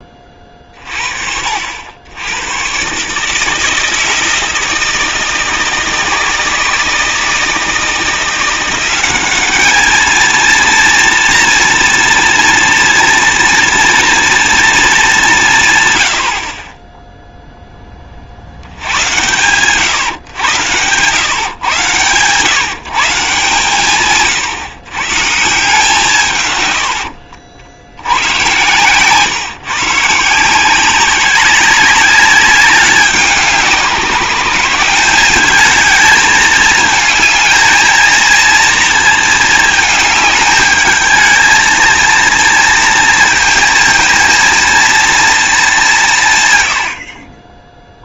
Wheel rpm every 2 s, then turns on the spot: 30, 120, 160, 160, 180, 230, 230, 230, 40, 70, 110, 150, 130, 110, 130, 180, 200, 170, 210, 230, 210, 230, 230, 110.
none